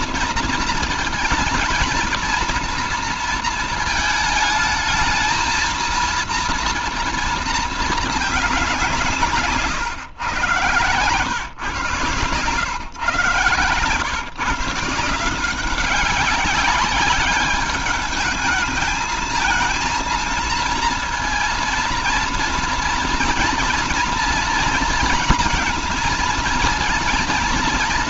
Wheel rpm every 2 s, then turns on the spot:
230, 230, 220, 230, 200, 130, 130, 140, 200, 210, 230, 230, 230, 230.
none